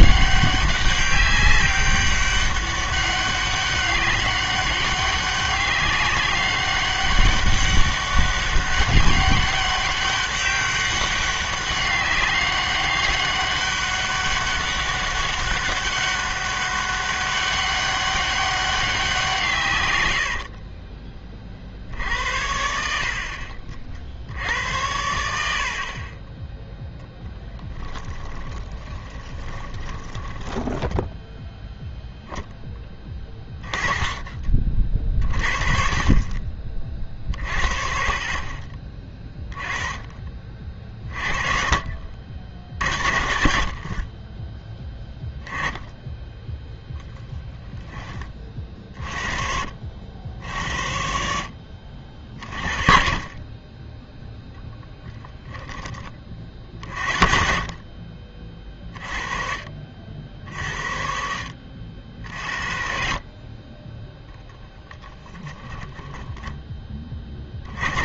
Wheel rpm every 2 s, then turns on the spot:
200, 200, 200, 200, 200, 200, 200, 200, 200, 190, 50, 70, 80, 0, 20, 10, 10, 40, 40, 30, 30, 60, 10, 0, 40, 70, 40, 10, 60, 30, 60, 50, 10, 10.
20-22 28-32 56-58